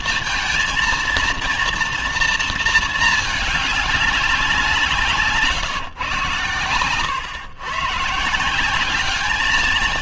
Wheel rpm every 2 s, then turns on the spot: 230, 230, 180, 120, 180.
none